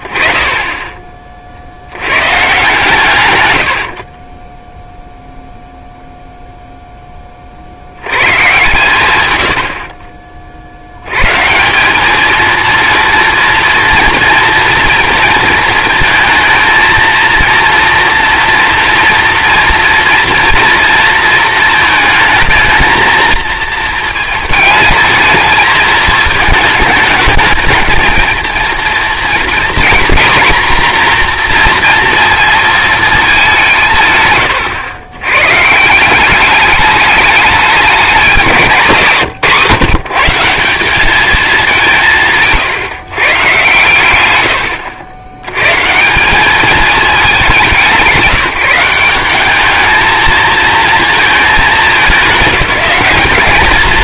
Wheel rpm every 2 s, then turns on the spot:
20, 140, 10, 0, 130, 60, 230, 230, 220, 230, 230, 220, 220, 220, 230, 240, 230, 130, 210, 180, 180, 150, 100, 200, 180, 230, 190.
42-44